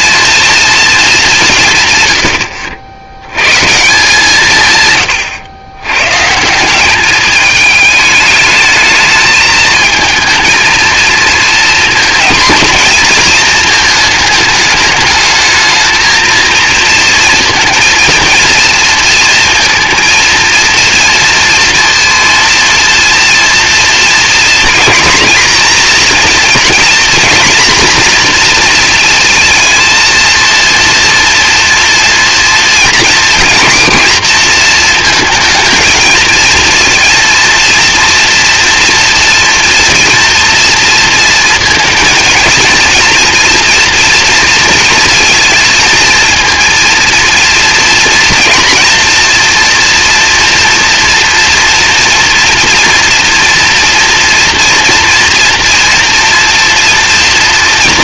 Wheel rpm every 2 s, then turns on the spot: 230, 100, 140, 180, 220, 220, 230, 220, 230, 230, 230, 230, 230, 230, 240, 230, 240, 230, 230, 230, 230, 230, 230, 230, 230, 230, 230, 230, 230.
none